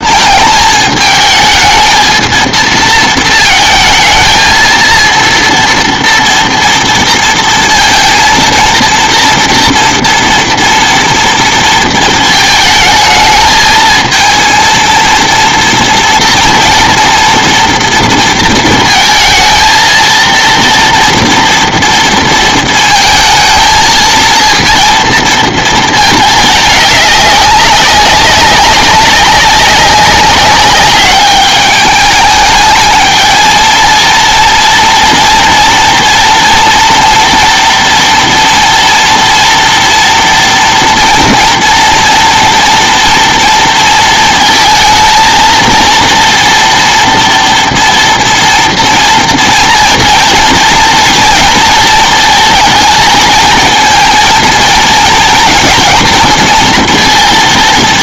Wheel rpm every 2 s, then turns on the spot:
220, 230, 230, 230, 230, 230, 220, 230, 240, 230, 230, 220, 220, 210, 200, 200, 220, 230, 230, 230, 230, 230, 220, 230, 230, 230, 220, 230, 230.
none